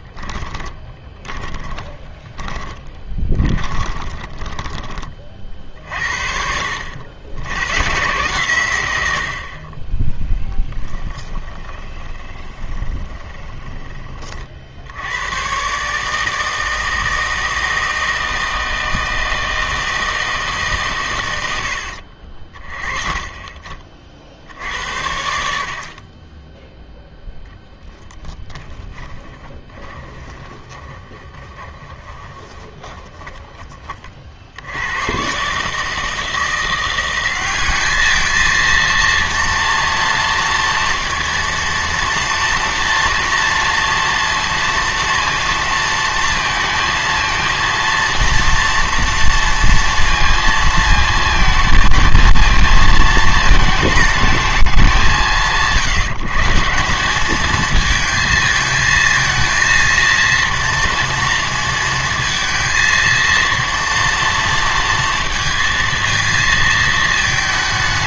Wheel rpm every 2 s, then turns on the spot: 20, 20, 20, 70, 100, 10, 20, 60, 160, 160, 140, 40, 80, 10, 10, 20, 20, 90, 180, 230, 230, 230, 230, 230, 230, 230, 220, 200, 170, 220, 230, 230, 230, 220.
0-4 10-14 28-34